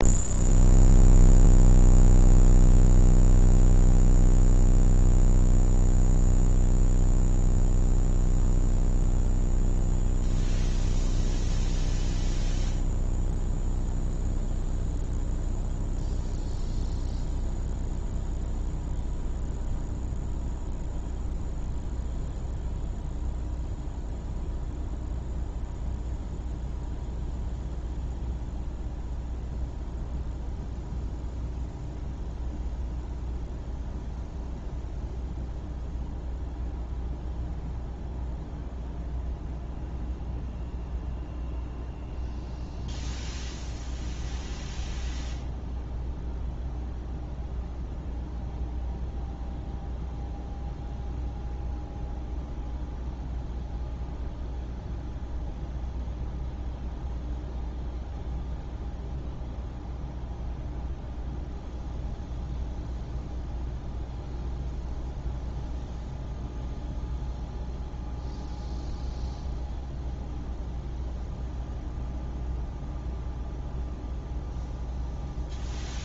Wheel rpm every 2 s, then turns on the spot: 0, 0, 0, 0, 0, 0, 0, 0, 0, 0, 0, 0, 0, 0, 0, 0, 0, 0, 0, 0, 0, 0, 0, 0, 0, 0, 0, 0, 0, 0, 0, 0, 0, 0, 0, 0, 0, 0.
none